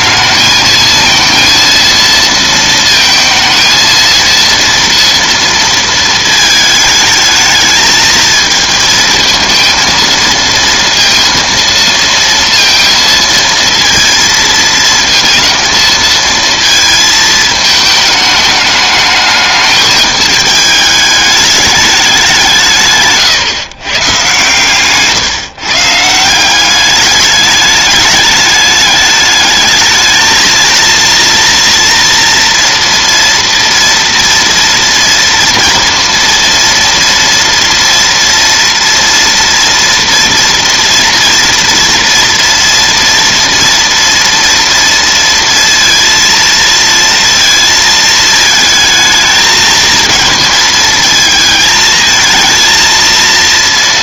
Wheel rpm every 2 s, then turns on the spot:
220, 220, 230, 220, 220, 230, 230, 220, 230, 210, 210, 160, 140, 200, 210, 230, 230, 240, 230, 230, 230, 230, 230, 230, 220, 230, 230.
none